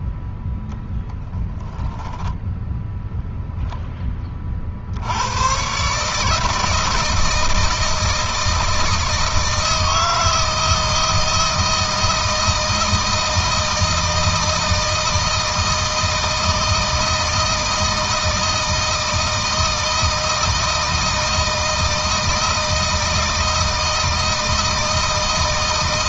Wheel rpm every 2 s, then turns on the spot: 0, 10, 50, 160, 160, 160, 170, 160, 160, 170, 160, 160, 160.
none